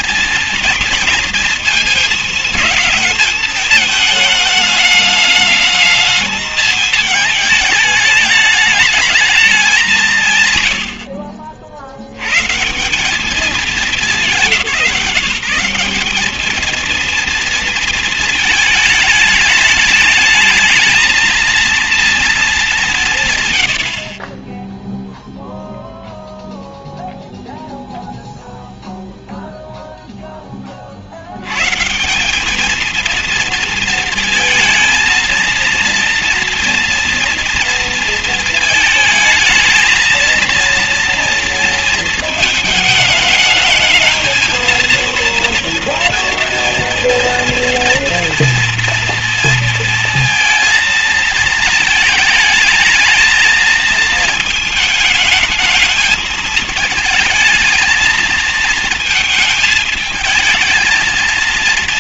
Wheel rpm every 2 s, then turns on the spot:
230, 210, 220, 220, 210, 140, 150, 180, 220, 220, 210, 210, 20, 0, 0, 20, 210, 220, 230, 230, 230, 220, 220, 230, 230, 230, 220, 220, 220, 220, 220.
none